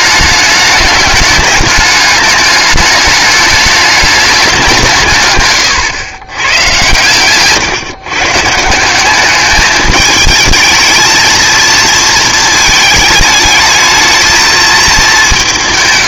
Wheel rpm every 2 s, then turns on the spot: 210, 210, 180, 110, 160, 220, 220, 220.
none